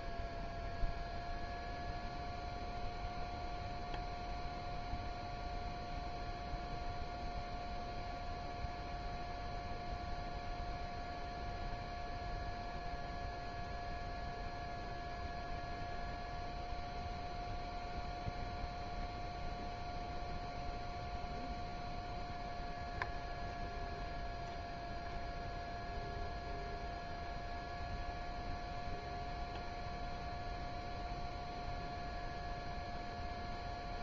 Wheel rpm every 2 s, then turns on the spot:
0, 0, 0, 0, 0, 0, 0, 0, 0, 0, 0, 0, 0, 0, 0, 0, 0.
none